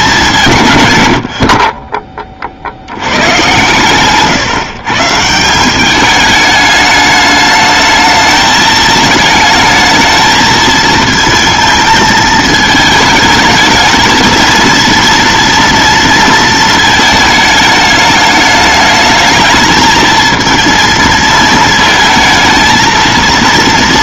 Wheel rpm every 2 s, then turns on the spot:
120, 60, 140, 210, 220, 220, 220, 230, 220, 210, 230, 230.
none